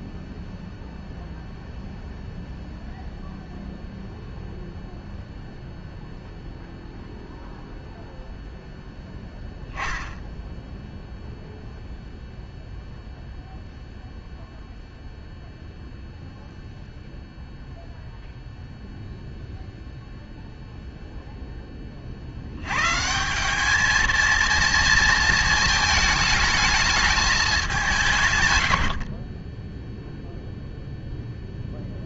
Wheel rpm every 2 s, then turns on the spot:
0, 0, 0, 0, 0, 0, 0, 0, 0, 0, 0, 120, 230, 210, 80, 0.
none